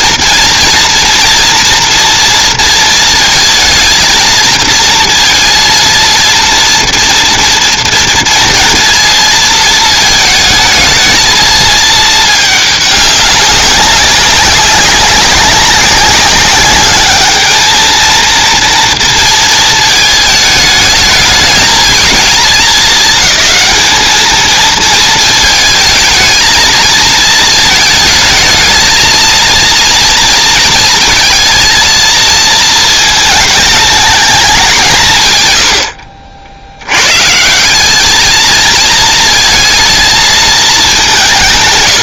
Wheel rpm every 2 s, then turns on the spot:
230, 230, 220, 230, 230, 220, 210, 190, 200, 230, 220, 210, 220, 220, 220, 230, 230, 180, 80, 220, 220.
none